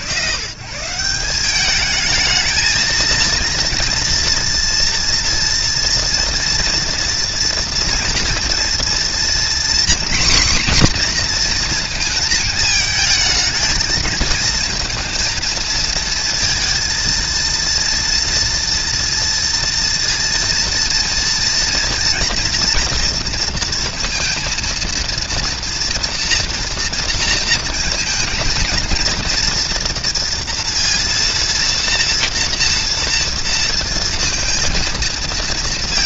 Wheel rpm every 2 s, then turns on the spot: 130, 220, 230, 230, 230, 250, 220, 230, 230, 230, 230, 240, 230, 230, 220, 230, 230, 230.
none